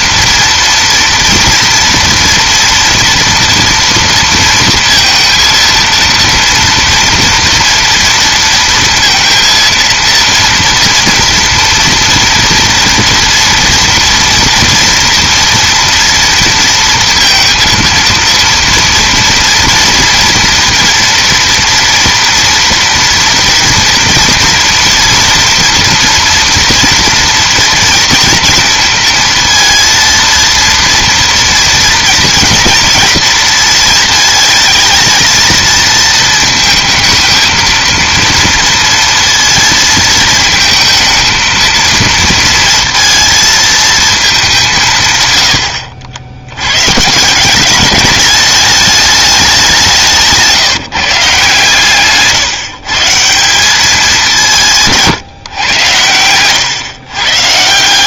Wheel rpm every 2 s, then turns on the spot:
230, 230, 230, 230, 230, 230, 230, 230, 230, 230, 230, 230, 230, 230, 230, 230, 230, 220, 220, 230, 230, 230, 150, 120, 210, 160, 160, 150, 120.
none